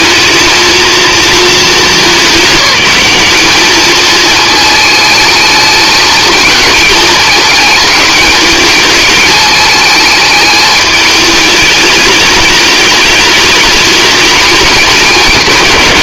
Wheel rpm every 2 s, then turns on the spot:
230, 200, 220, 220, 210, 210, 210, 210.
none